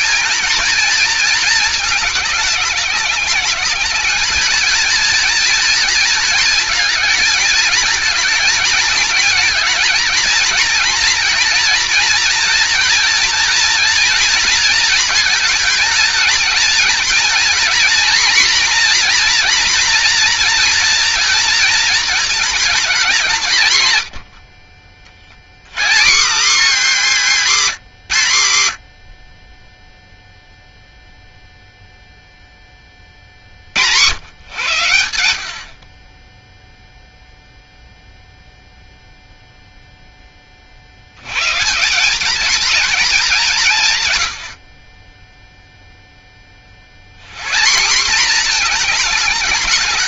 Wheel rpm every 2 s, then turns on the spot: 230, 200, 220, 220, 220, 230, 230, 230, 230, 240, 240, 230, 50, 230, 100, 0, 10, 110, 0, 0, 30, 220, 60, 30, 220.
none